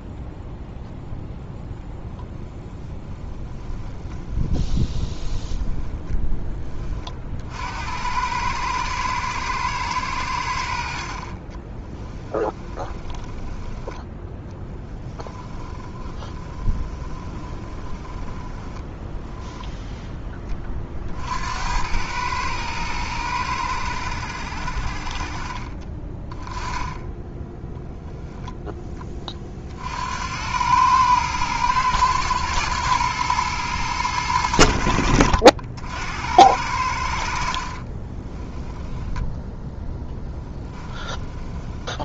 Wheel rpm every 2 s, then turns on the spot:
0, 0, 10, 40, 110, 50, 20, 20, 20, 10, 50, 110, 50, 10, 10, 110, 110, 70, 70, 10, 20.
4-6 12-20 38-42